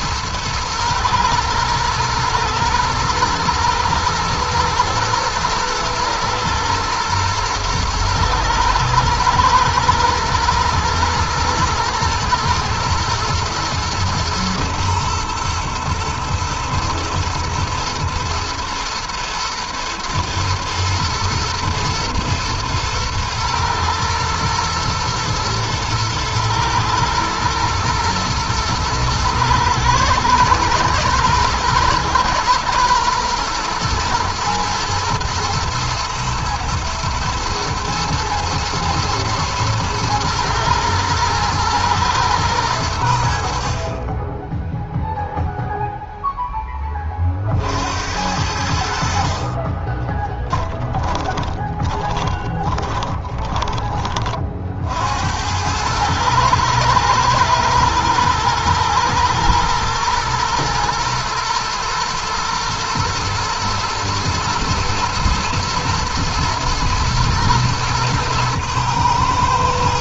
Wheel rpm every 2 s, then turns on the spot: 110, 120, 120, 110, 110, 110, 120, 110, 110, 120, 120, 110, 110, 110, 110, 110, 120, 110, 110, 110, 110, 80, 0, 30, 60, 10, 20, 70, 110, 110, 120, 110, 110, 110, 110.
50-54